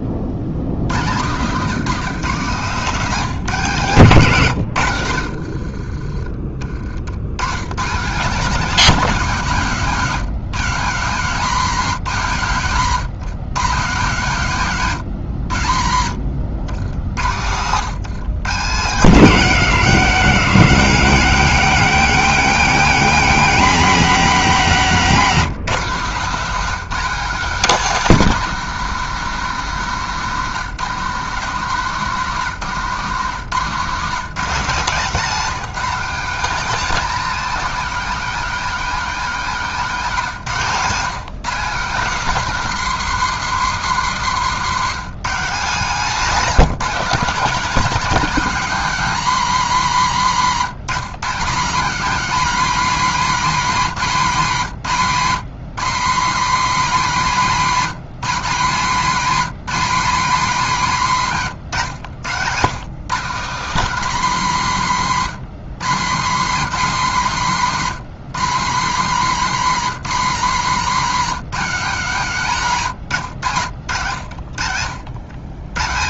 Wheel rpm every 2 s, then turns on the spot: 90, 160, 100, 50, 210, 160, 130, 140, 90, 160, 200, 210, 210, 200, 220, 160, 150, 170, 220, 220, 160, 220, 190, 210, 200, 150, 230, 170, 200, 190, 200, 150, 160, 180, 160, 170, 150, 60.
4-6 34-36